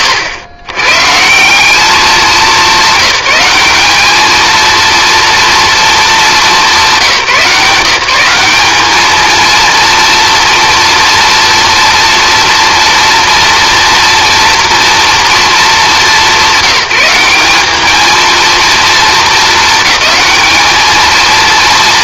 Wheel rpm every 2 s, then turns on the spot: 140, 200, 230, 190, 220, 230, 230, 230, 180, 220, 220.
none